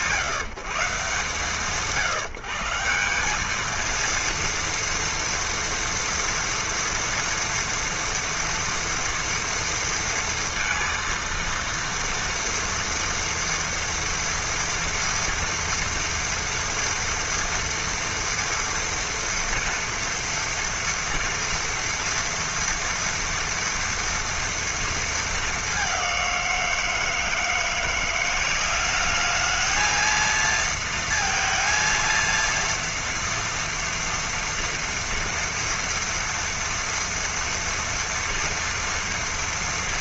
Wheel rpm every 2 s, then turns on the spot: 140, 190, 230, 230, 230, 230, 230, 230, 230, 240, 230, 230, 220, 160, 210, 230, 230, 230, 230, 230.
none